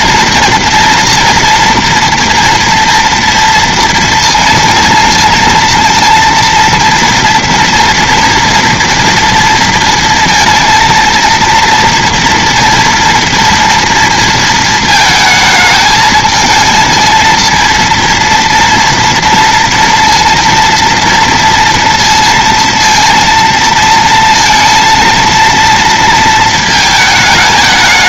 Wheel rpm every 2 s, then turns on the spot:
240, 240, 230, 230, 230, 230, 230, 220, 220, 230, 230, 230, 230, 220.
none